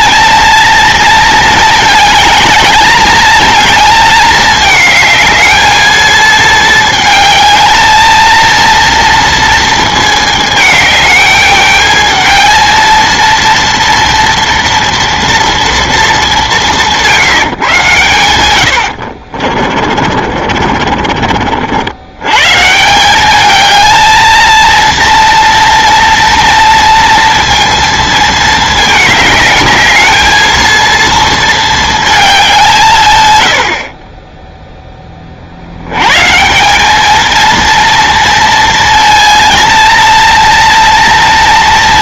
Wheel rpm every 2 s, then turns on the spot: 230, 210, 210, 220, 230, 210, 220, 240, 180, 70, 40, 150, 220, 230, 220, 220, 170, 10, 180, 230, 230.
18-22